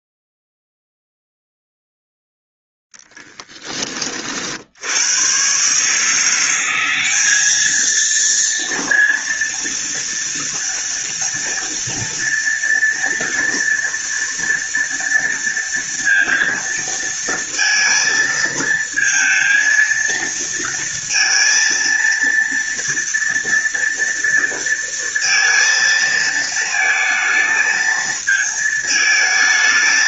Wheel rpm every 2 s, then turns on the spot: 0, 0, 90, 190, 230, 230, 230, 230, 230, 230, 230, 230, 230, 220, 220.
none